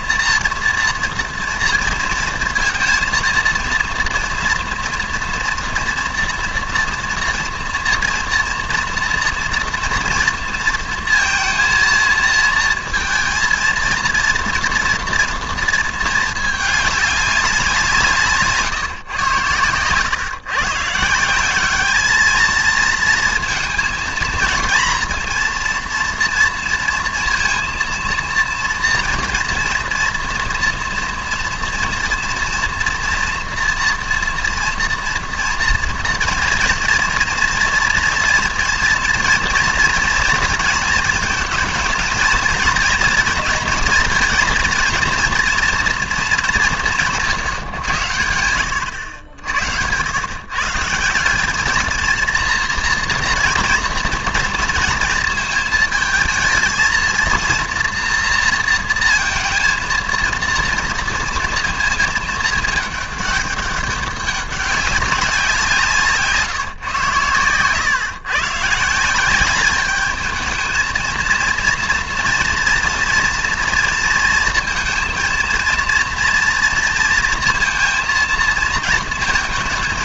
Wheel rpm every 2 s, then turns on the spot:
230, 230, 230, 230, 230, 230, 230, 230, 210, 150, 140, 220, 230, 230, 230, 230, 230, 230, 230, 240, 220, 230, 230, 180, 90, 150, 230, 230, 220, 230, 230, 220, 200, 140, 150, 220, 240, 230, 230, 220.
none